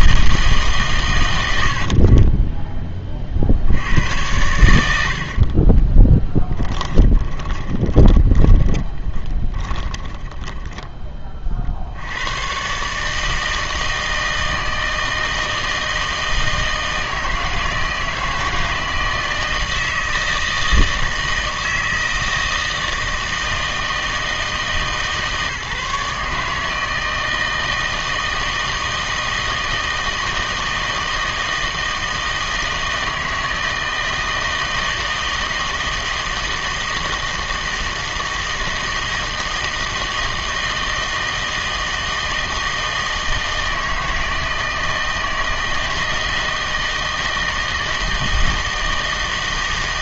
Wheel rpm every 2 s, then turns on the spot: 120, 30, 70, 10, 20, 10, 130, 160, 160, 160, 160, 160, 160, 160, 160, 160, 160, 160, 160, 160, 160, 160, 160, 160, 160.
6-10